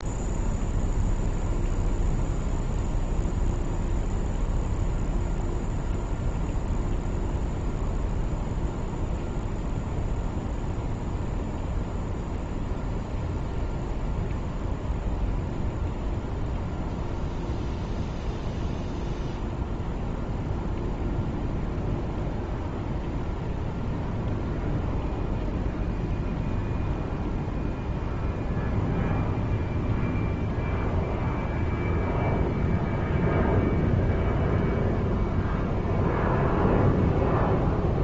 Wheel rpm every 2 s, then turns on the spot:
0, 0, 0, 0, 0, 0, 0, 0, 0, 0, 0, 0, 0, 0, 0, 0, 0, 0, 0.
none